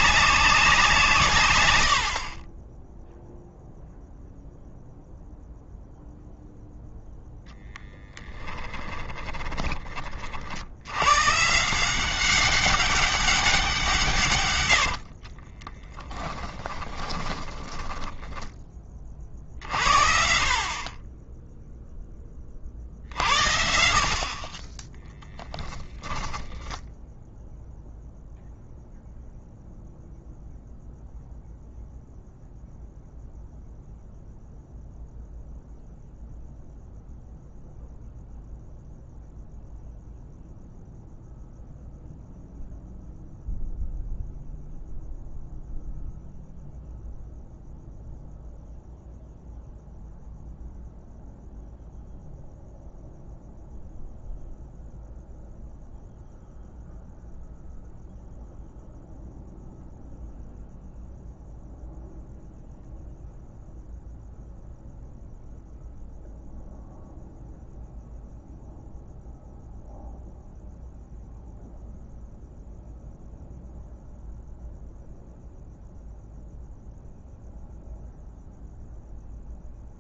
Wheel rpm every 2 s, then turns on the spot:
160, 10, 0, 0, 10, 90, 190, 90, 10, 20, 40, 50, 30, 10, 0, 0, 0, 0, 0, 0, 0, 0, 0, 0, 0, 0, 0, 0, 0, 0, 0, 0, 0, 0, 0, 0, 0, 0, 0, 0.
8-10 14-18 24-28